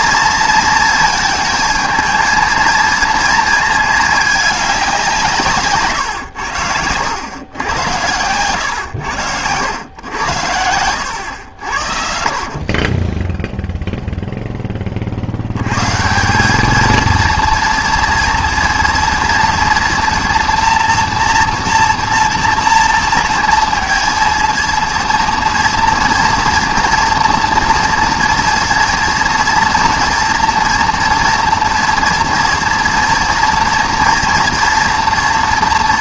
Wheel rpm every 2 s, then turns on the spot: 230, 230, 200, 90, 100, 90, 30, 10, 200, 230, 240, 230, 230, 230, 230, 230, 230, 230.
6-8